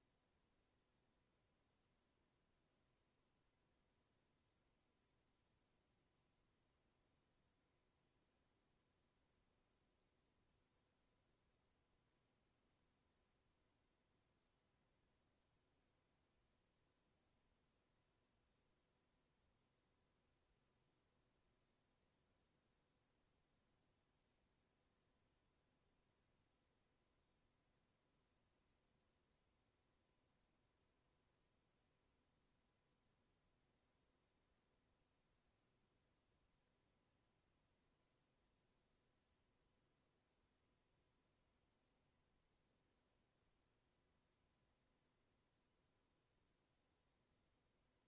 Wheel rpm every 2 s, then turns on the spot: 0, 0, 0, 0, 0, 0, 0, 0, 0, 0, 0, 0, 0, 0, 0, 0, 0, 0, 0, 0, 0, 0, 0, 0.
none